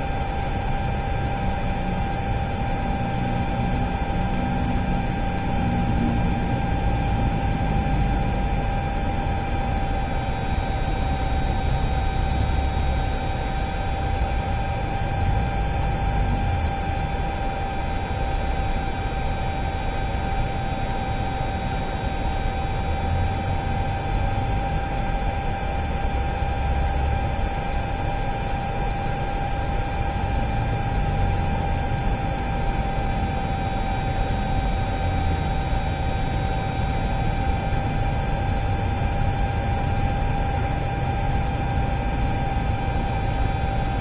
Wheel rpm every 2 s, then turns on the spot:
0, 0, 0, 0, 0, 0, 0, 0, 0, 0, 0, 0, 0, 0, 0, 0, 0, 0, 0, 0, 0, 0.
none